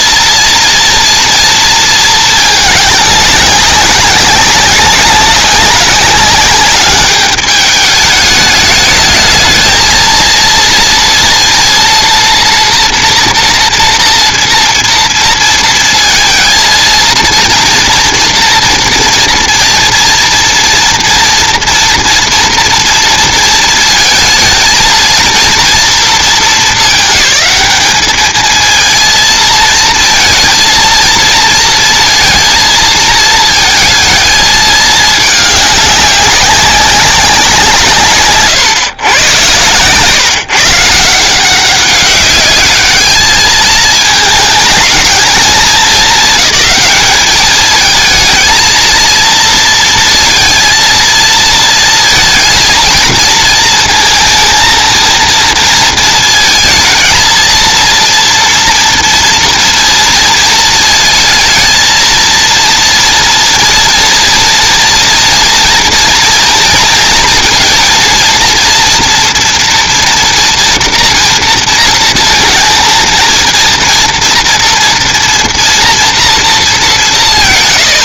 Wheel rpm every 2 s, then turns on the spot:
240, 210, 190, 200, 210, 230, 230, 230, 230, 230, 230, 240, 230, 200, 220, 230, 230, 220, 190, 130, 150, 200, 220, 210, 220, 230, 230, 220, 220, 230, 220, 230, 230, 230, 230, 230, 230, 230, 210.
none